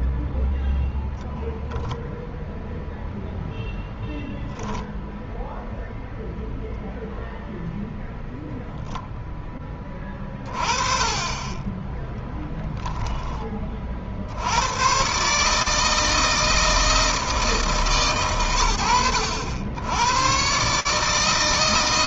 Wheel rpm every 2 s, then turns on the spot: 0, 0, 10, 0, 0, 30, 10, 110, 160, 90, 140.
none